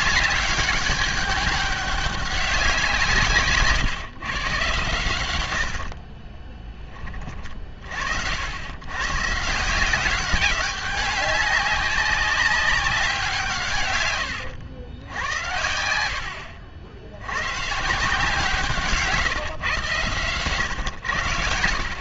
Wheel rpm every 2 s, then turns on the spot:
200, 170, 110, 20, 120, 200, 190, 100, 80, 150, 100.
none